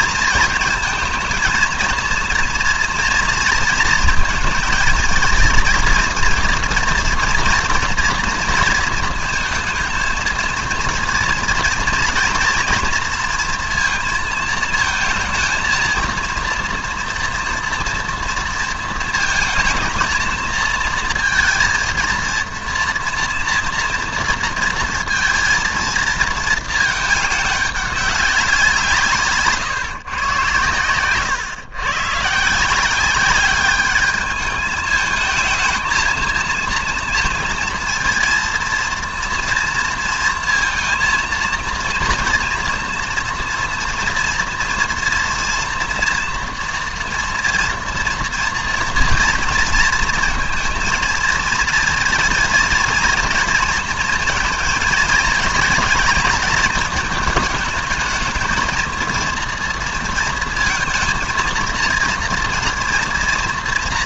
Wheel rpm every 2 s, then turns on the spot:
220, 230, 230, 230, 220, 230, 230, 230, 240, 230, 220, 230, 230, 220, 180, 120, 160, 210, 230, 230, 230, 230, 230, 230, 230, 230, 230, 230, 220, 220, 230, 230.
none